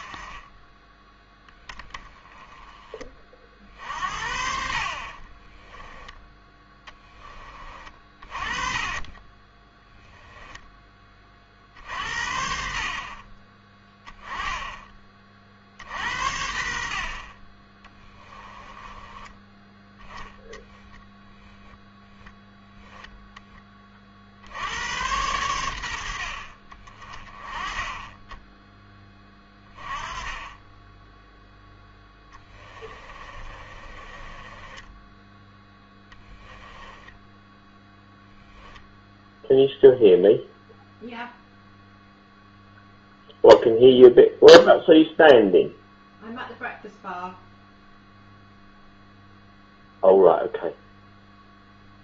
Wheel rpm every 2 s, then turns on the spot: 20, 20, 50, 10, 30, 20, 60, 20, 60, 20, 10, 10, 90, 40, 10, 10, 20, 20, 10, 0, 0, 0, 0, 0, 0, 0.
8-10 18-22 32-36